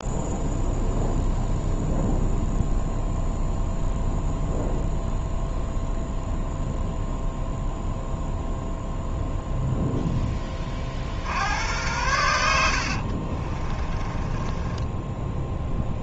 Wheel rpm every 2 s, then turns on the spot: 0, 0, 0, 0, 0, 50, 70, 10.
12-16